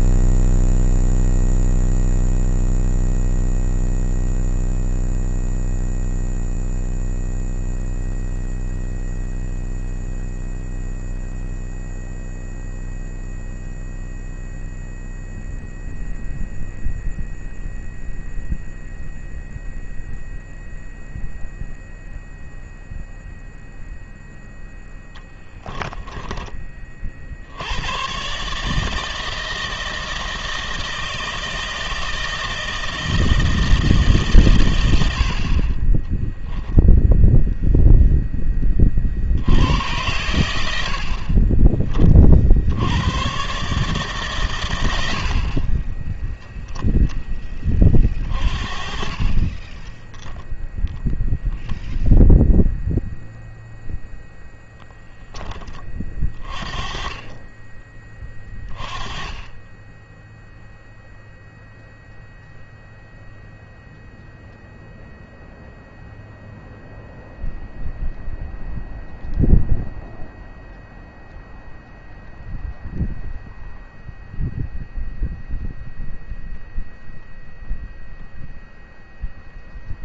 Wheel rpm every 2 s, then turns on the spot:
0, 0, 0, 0, 0, 0, 0, 0, 0, 0, 0, 0, 0, 20, 140, 160, 160, 110, 0, 30, 90, 70, 110, 0, 40, 0, 0, 0, 30, 20, 0, 0, 0, 0, 0, 0, 0, 0, 0, 0.
none